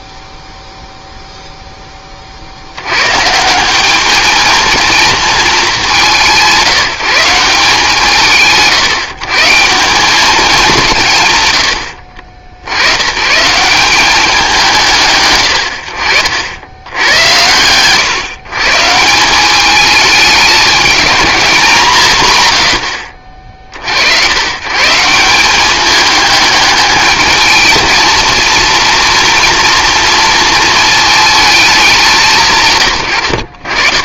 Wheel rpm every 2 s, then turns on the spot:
0, 80, 220, 170, 140, 180, 90, 170, 90, 150, 210, 110, 130, 210, 230, 220, 130.
none